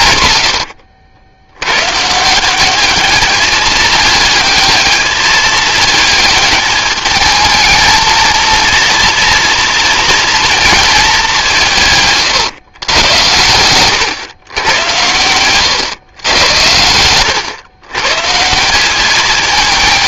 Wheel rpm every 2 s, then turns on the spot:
60, 200, 210, 220, 230, 210, 110, 100, 110, 200.
none